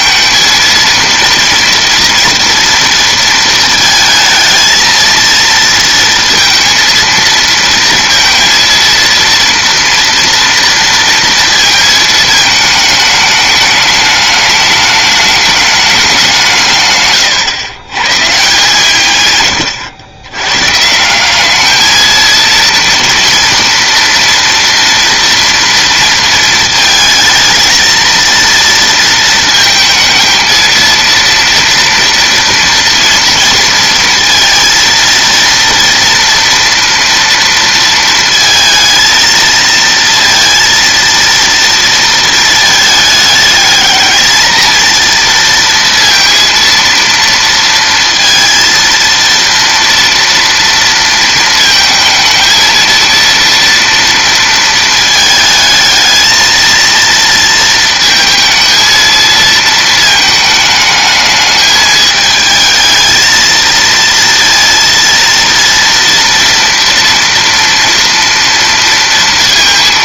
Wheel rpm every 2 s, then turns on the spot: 230, 230, 230, 230, 230, 230, 210, 210, 140, 140, 160, 230, 230, 220, 230, 230, 230, 230, 230, 220, 230, 210, 230, 230, 230, 230, 230, 220, 230, 230, 210, 220, 230, 230, 230.
none